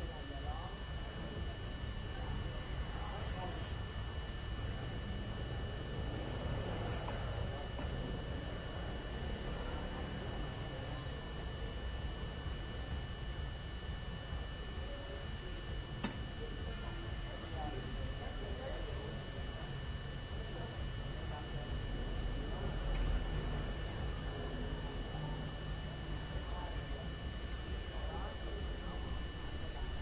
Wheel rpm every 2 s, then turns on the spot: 0, 0, 0, 0, 0, 0, 0, 0, 0, 0, 0, 0, 0, 0, 0.
none